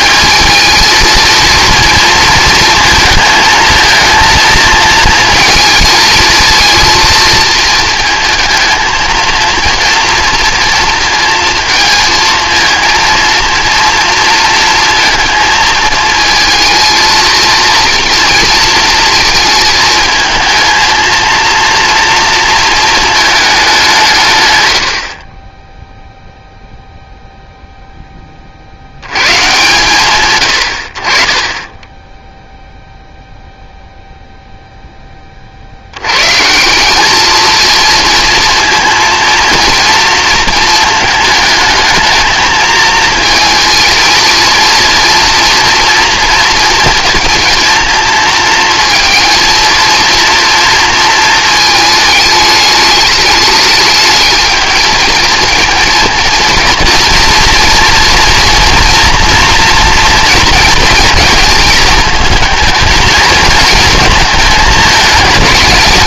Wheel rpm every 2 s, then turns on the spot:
220, 230, 230, 230, 220, 230, 230, 220, 220, 230, 220, 230, 100, 0, 60, 50, 0, 0, 180, 230, 220, 220, 230, 240, 230, 230, 210, 220, 230, 240, 220, 220, 210.
none